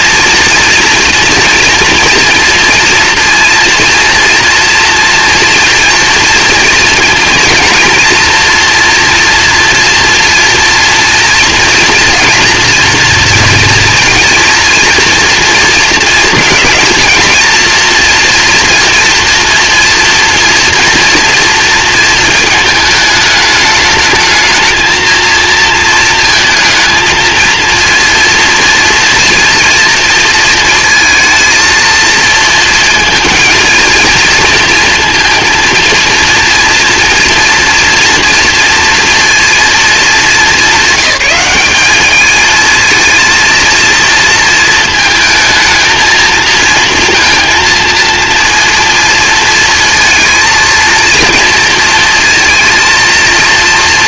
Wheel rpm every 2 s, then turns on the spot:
230, 240, 240, 230, 230, 230, 230, 230, 230, 230, 230, 220, 220, 220, 230, 230, 230, 230, 230, 240, 200, 220, 220, 230, 230, 230, 230.
none